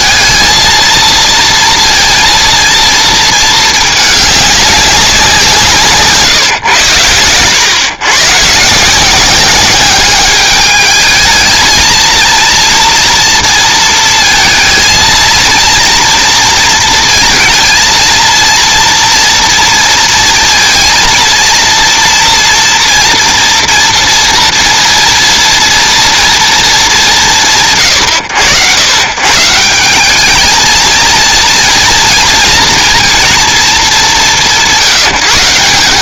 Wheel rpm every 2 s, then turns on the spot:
230, 230, 200, 130, 150, 210, 230, 220, 230, 230, 230, 240, 230, 200, 90, 220, 230, 140.
none